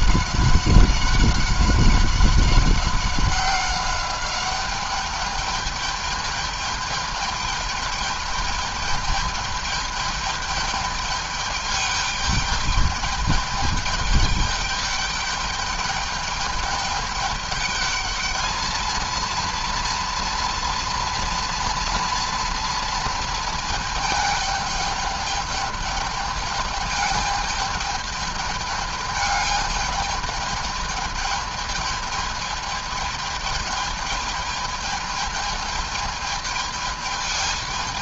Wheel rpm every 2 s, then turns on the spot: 190, 190, 200, 210, 210, 210, 210, 210, 210, 220, 230, 230, 210, 210, 210, 210, 210, 210, 210.
none